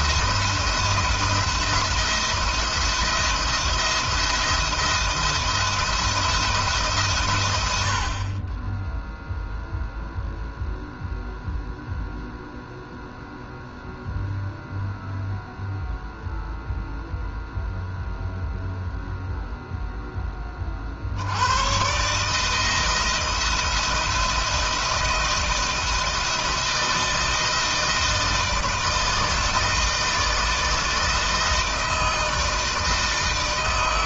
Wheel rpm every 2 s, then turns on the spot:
170, 170, 170, 160, 30, 0, 0, 0, 0, 0, 30, 160, 170, 160, 160, 160, 160.
none